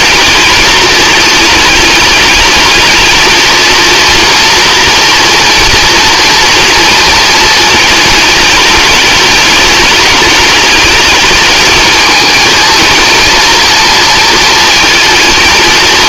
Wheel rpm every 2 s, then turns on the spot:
220, 220, 230, 230, 210, 210, 220, 230.
none